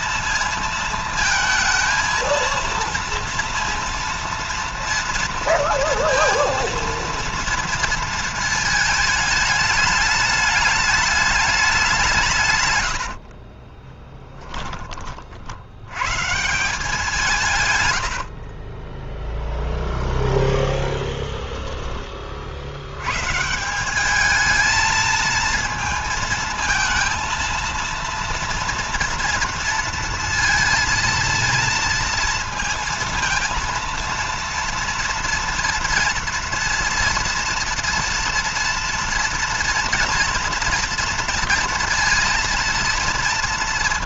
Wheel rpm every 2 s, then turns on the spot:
230, 230, 230, 230, 220, 210, 90, 30, 170, 20, 10, 90, 220, 230, 230, 230, 230, 230, 230, 240, 240, 230.
12-14 18-20